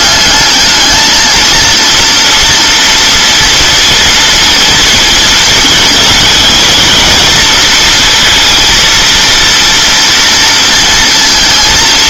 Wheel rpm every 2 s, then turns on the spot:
210, 230, 230, 230, 230, 230.
none